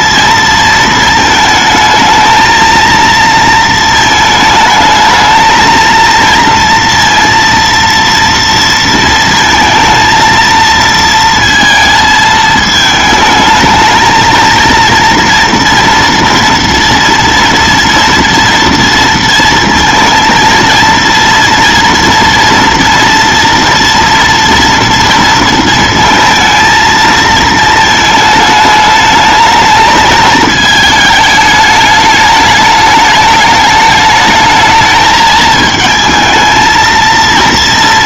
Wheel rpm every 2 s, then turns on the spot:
220, 220, 220, 230, 230, 230, 220, 220, 240, 230, 230, 230, 230, 230, 220, 220, 210, 220, 220.
none